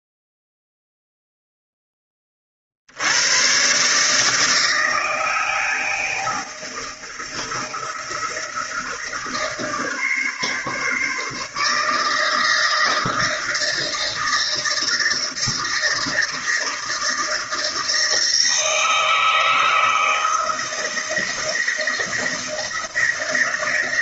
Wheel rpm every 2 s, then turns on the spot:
0, 70, 160, 160, 160, 140, 160, 160, 160, 160, 160, 160.
none